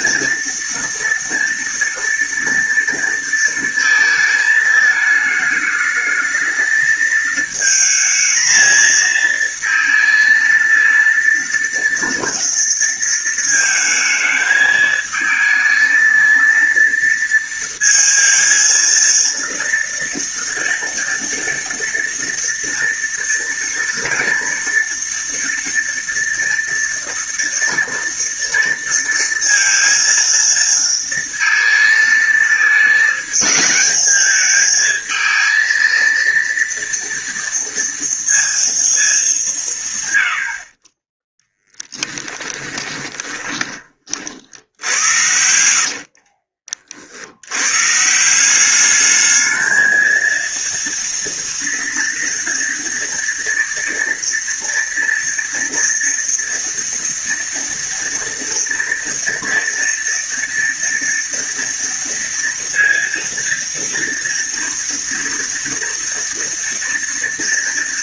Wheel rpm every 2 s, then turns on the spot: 230, 230, 220, 220, 230, 230, 230, 220, 230, 230, 230, 230, 230, 230, 230, 230, 220, 220, 230, 220, 20, 10, 70, 40, 200, 230, 230, 230, 230, 230, 230, 230, 230, 230.
42-46